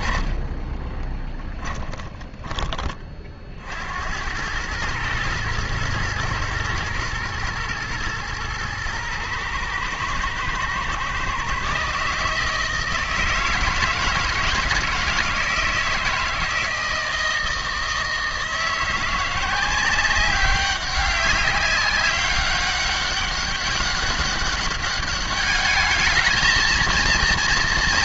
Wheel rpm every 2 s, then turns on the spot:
10, 30, 110, 120, 120, 120, 160, 160, 160, 170, 200, 200, 200, 220.
0-2